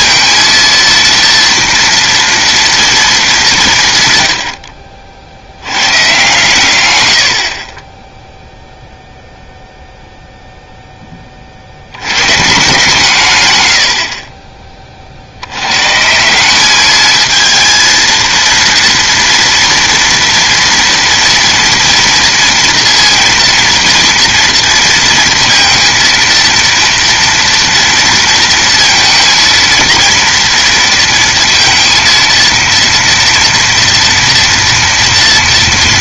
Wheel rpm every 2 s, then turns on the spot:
230, 230, 60, 120, 0, 0, 160, 30, 190, 230, 230, 230, 230, 230, 230, 230, 230, 230.
none